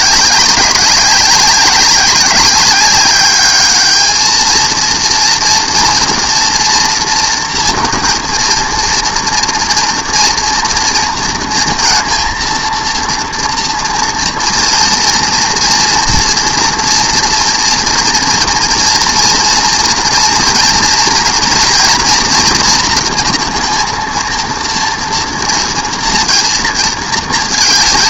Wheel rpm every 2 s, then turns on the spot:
200, 200, 220, 230, 230, 230, 230, 230, 240, 230, 240, 230, 230, 230.
none